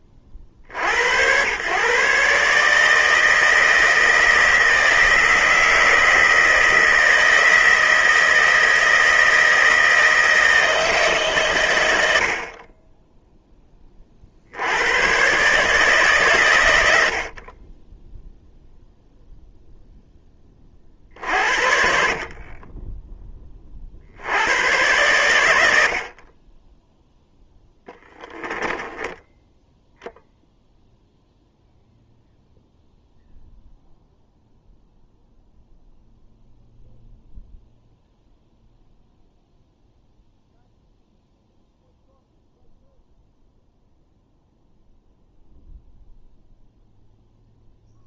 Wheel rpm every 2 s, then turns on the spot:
50, 150, 160, 160, 160, 160, 20, 90, 80, 0, 30, 20, 110, 10, 30, 0, 0, 0, 0, 0, 0, 0, 0, 0.
28-30